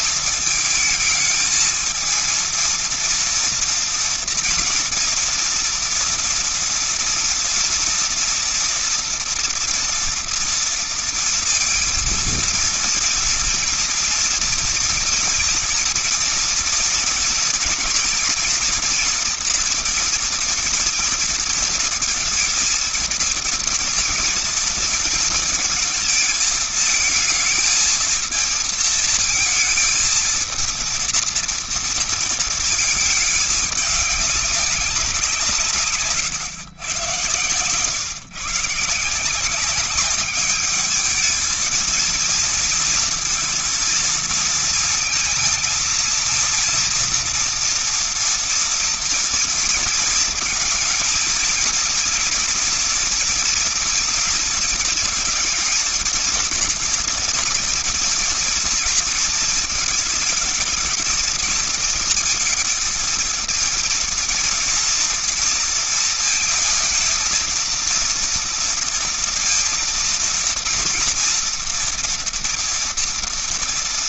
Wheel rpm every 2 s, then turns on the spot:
220, 230, 230, 230, 230, 240, 230, 230, 230, 230, 240, 230, 230, 220, 220, 230, 230, 200, 130, 140, 200, 230, 230, 230, 230, 230, 230, 230, 230, 230, 220, 220, 230, 230, 230, 230, 230.
none